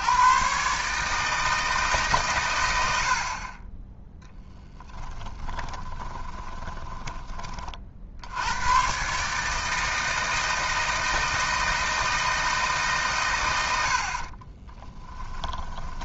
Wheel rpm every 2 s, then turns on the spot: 140, 90, 10, 20, 110, 160, 150, 20.
4-8 14-16